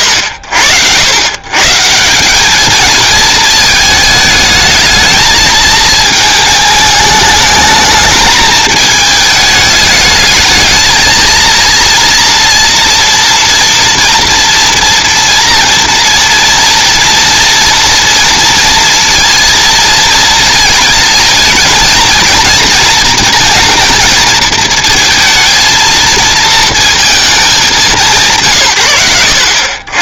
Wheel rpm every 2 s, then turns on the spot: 90, 200, 210, 210, 220, 220, 230, 230, 230, 230, 220, 220, 220, 230, 120.
none